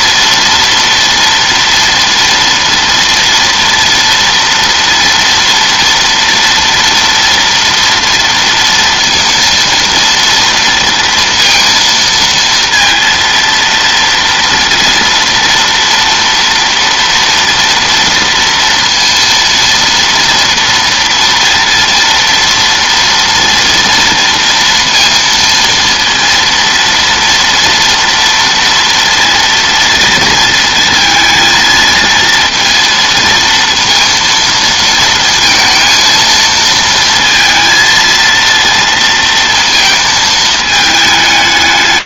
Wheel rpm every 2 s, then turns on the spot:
230, 230, 230, 230, 230, 230, 230, 230, 230, 230, 230, 230, 230, 230, 230, 230, 230, 230, 220, 230, 220.
none